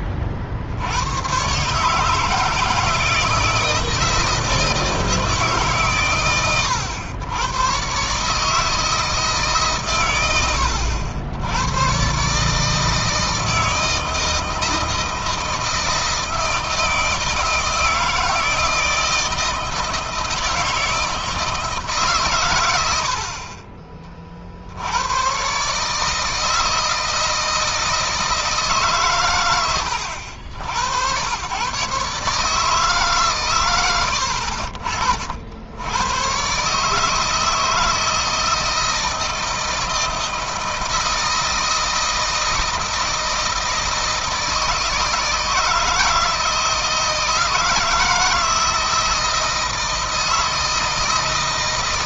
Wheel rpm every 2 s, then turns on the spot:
70, 160, 160, 100, 150, 90, 150, 160, 160, 160, 160, 90, 60, 160, 150, 90, 150, 60, 130, 160, 160, 160, 160, 160, 160, 160.
none